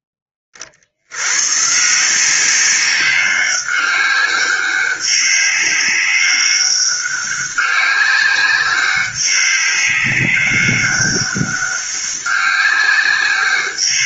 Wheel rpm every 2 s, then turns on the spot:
30, 190, 200, 200, 190, 200, 190.
none